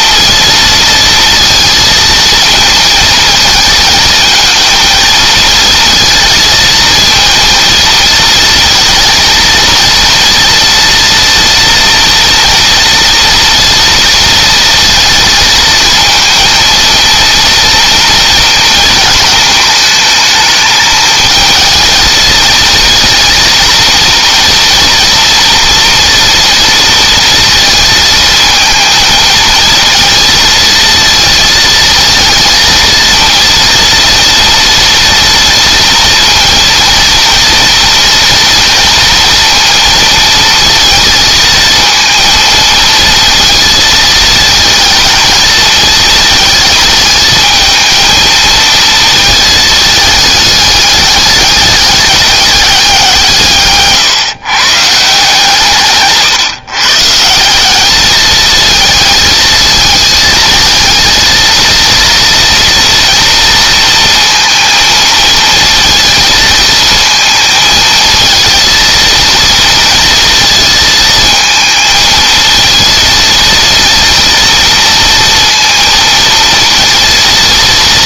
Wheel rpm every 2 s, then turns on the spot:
230, 230, 220, 230, 230, 230, 240, 230, 230, 230, 220, 230, 230, 230, 220, 230, 230, 230, 230, 230, 230, 230, 220, 220, 230, 210, 190, 140, 130, 220, 220, 230, 230, 220, 230, 230, 220, 230, 230.
none